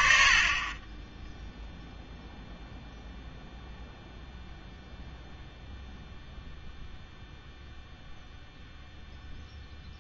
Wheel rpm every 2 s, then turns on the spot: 40, 0, 0, 0, 0.
none